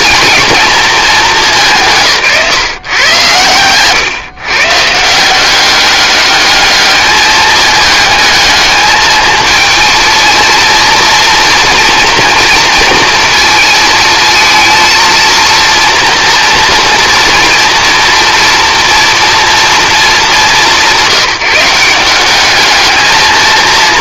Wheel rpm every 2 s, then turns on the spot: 220, 130, 140, 210, 220, 230, 230, 230, 230, 230, 190, 210.
none